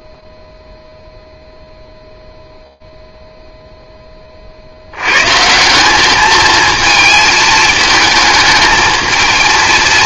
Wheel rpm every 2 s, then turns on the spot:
0, 0, 40, 220, 220.
none